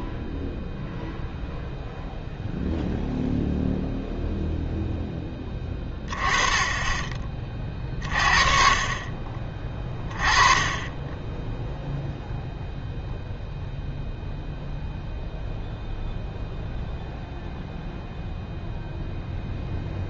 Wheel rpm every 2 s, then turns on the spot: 0, 0, 0, 20, 30, 20, 0, 0, 0, 0.
none